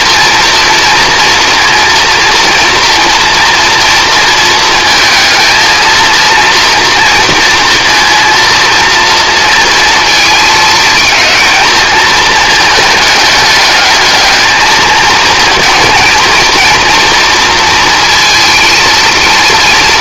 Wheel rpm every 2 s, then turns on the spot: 230, 240, 230, 230, 230, 220, 210, 220, 230, 230.
none